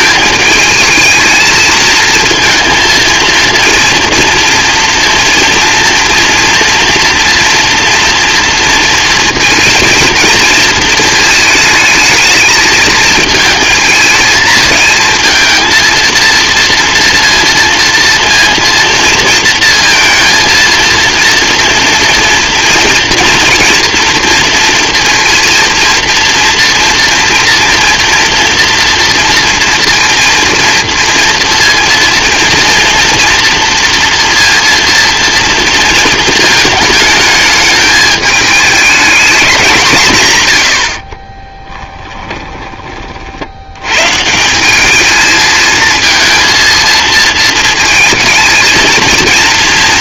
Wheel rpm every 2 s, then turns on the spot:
220, 230, 230, 230, 230, 230, 220, 220, 230, 230, 230, 240, 230, 230, 230, 230, 230, 230, 220, 210, 110, 20, 170, 230, 220.
42-44